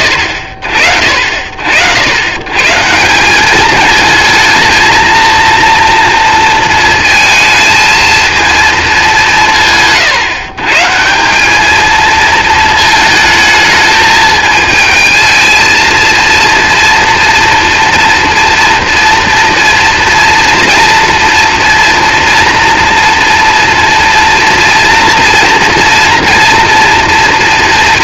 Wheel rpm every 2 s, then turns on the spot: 50, 160, 230, 230, 220, 160, 220, 220, 230, 230, 240, 230, 230, 230.
none